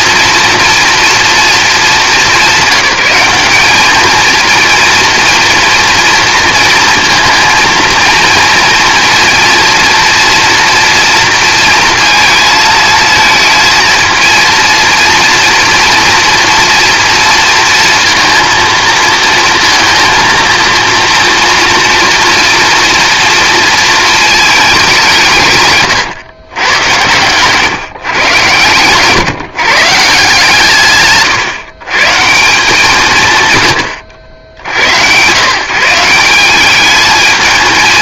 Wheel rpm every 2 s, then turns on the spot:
230, 200, 230, 220, 230, 230, 220, 230, 230, 230, 230, 230, 200, 110, 120, 150, 170, 90, 190.
none